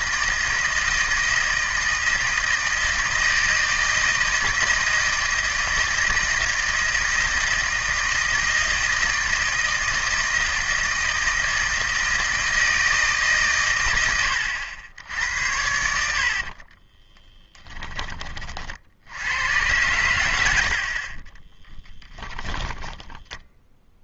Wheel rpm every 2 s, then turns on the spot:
160, 160, 160, 160, 160, 160, 160, 80, 50, 50, 70, 10.
16-18 22-24